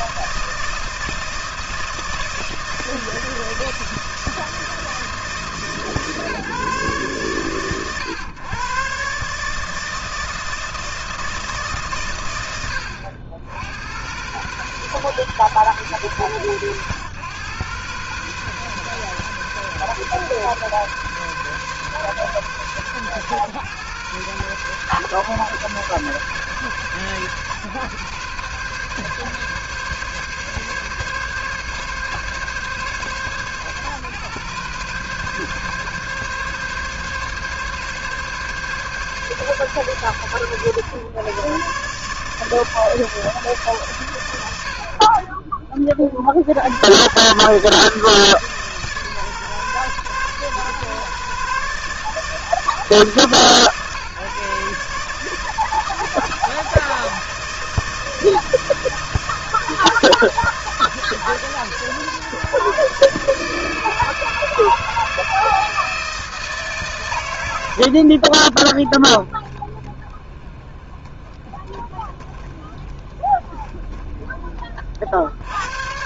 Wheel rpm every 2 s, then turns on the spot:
160, 160, 160, 150, 120, 160, 110, 120, 120, 120, 140, 120, 120, 140, 130, 140, 140, 130, 140, 140, 120, 140, 110, 60, 160, 130, 150, 140, 160, 160, 160, 140, 160, 160, 60, 20, 20, 20.
none